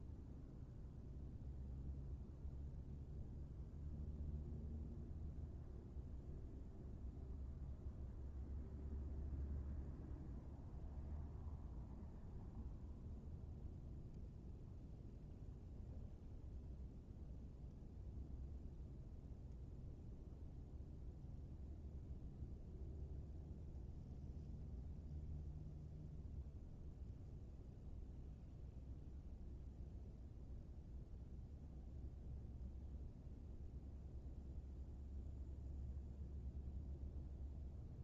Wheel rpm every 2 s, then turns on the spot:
0, 0, 0, 0, 0, 0, 0, 0, 0, 0, 0, 0, 0, 0, 0, 0, 0, 0, 0.
none